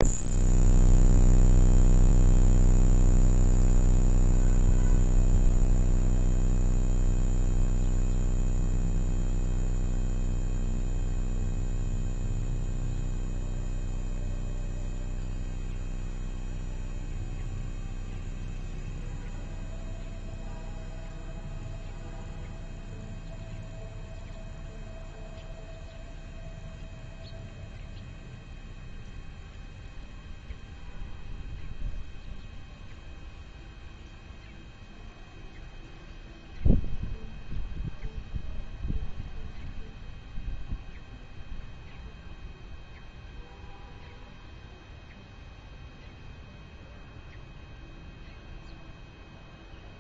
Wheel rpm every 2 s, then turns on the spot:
0, 0, 0, 0, 0, 0, 0, 0, 0, 0, 0, 0, 0, 0, 0, 0, 0, 0, 0, 0, 0, 0, 0, 0, 0.
none